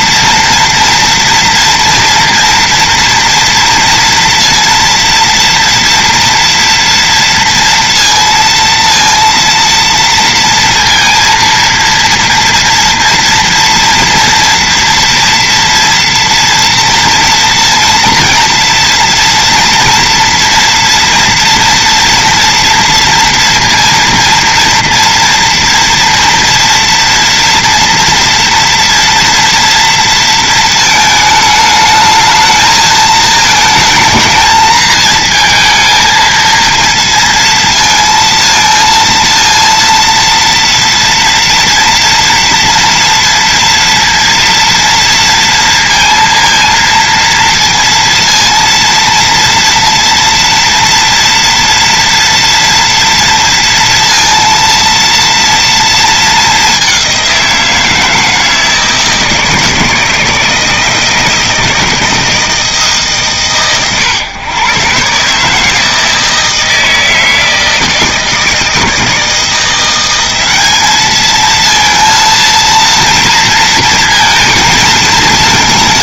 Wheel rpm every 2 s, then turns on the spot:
230, 230, 230, 230, 230, 230, 230, 230, 230, 230, 230, 230, 230, 230, 230, 220, 220, 220, 230, 230, 230, 230, 230, 230, 230, 230, 230, 230, 200, 160, 160, 160, 130, 160, 160, 200, 230, 220.
none